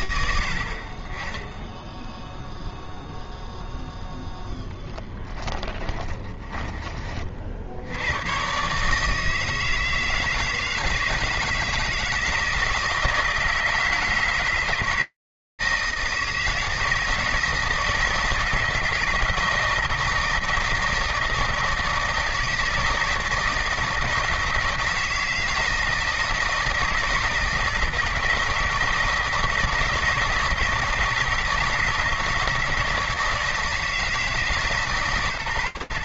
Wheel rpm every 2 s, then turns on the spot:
40, 0, 20, 30, 150, 160, 160, 160, 160, 160, 160, 160, 160, 160, 160, 160, 160, 150.
4-6